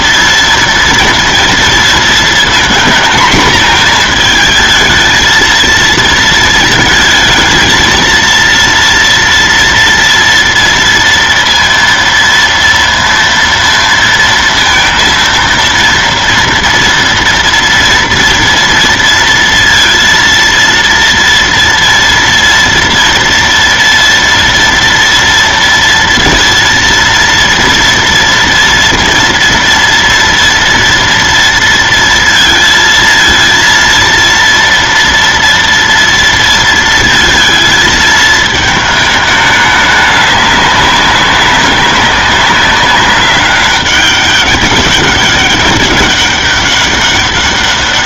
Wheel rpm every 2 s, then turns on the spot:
230, 230, 230, 230, 230, 230, 230, 230, 230, 230, 230, 230, 230, 230, 230, 230, 230, 230, 230, 220, 200, 200, 200, 200.
none